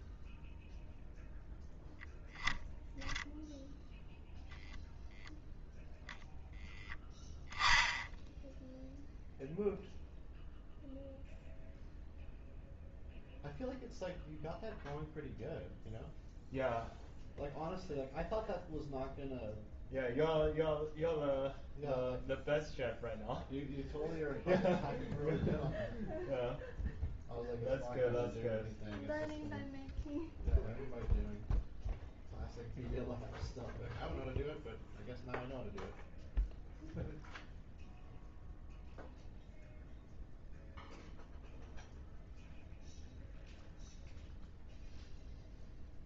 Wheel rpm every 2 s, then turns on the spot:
0, 0, 0, 0, 0, 0, 0, 0, 0, 0, 0, 0, 0, 0, 0, 0, 0, 0, 0, 0, 0, 0, 0.
none